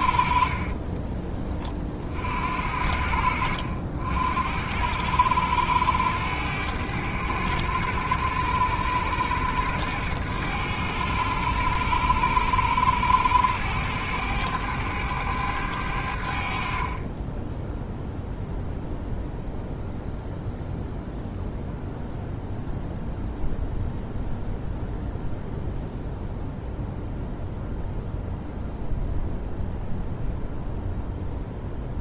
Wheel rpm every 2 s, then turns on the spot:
40, 60, 80, 100, 100, 100, 100, 100, 50, 0, 0, 0, 0, 0, 0, 0.
0-2